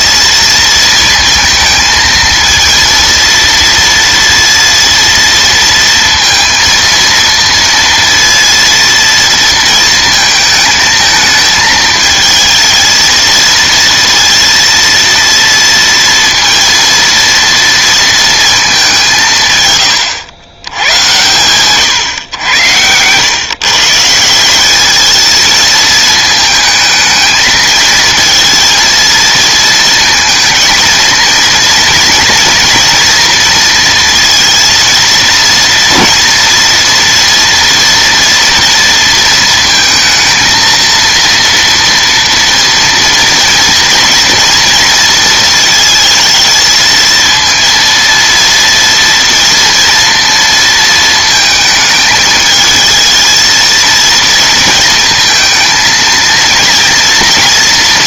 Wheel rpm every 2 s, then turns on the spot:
230, 230, 230, 230, 230, 220, 220, 230, 230, 210, 100, 110, 200, 220, 230, 230, 230, 230, 230, 230, 230, 230, 230, 220, 230, 230, 220, 220, 230.
none